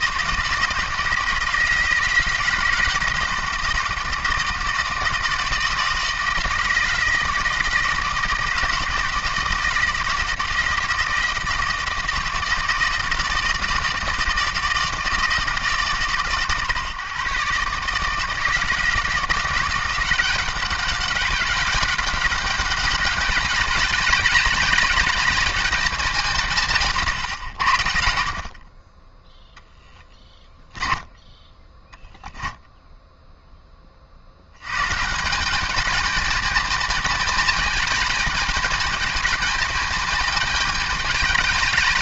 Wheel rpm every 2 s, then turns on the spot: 160, 160, 160, 160, 160, 160, 160, 160, 120, 160, 190, 190, 200, 150, 40, 20, 0, 120, 220, 220, 210.
30-32